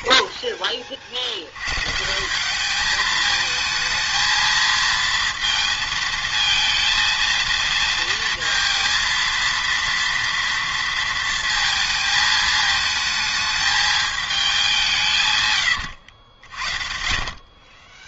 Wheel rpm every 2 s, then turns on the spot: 20, 210, 220, 230, 230, 230, 220, 200, 60.
16-18